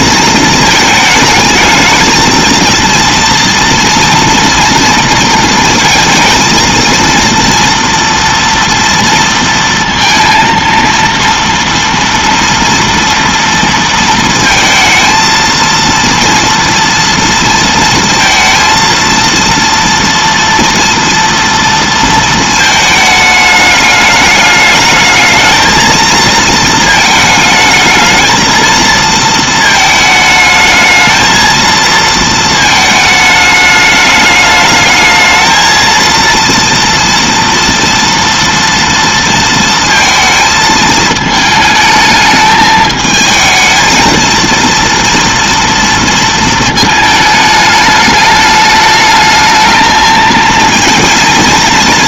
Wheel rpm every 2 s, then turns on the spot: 220, 230, 230, 230, 230, 230, 230, 230, 230, 230, 230, 220, 210, 230, 230, 220, 220, 210, 230, 230, 220, 220, 230, 220, 210, 230.
none